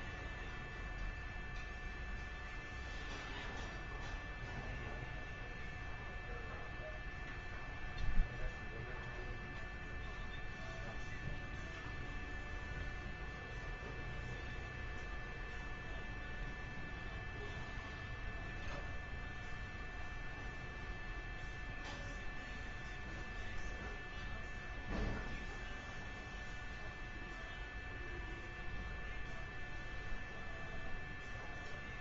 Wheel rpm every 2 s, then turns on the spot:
0, 0, 0, 0, 0, 0, 0, 0, 0, 0, 0, 0, 0, 0, 0, 0.
none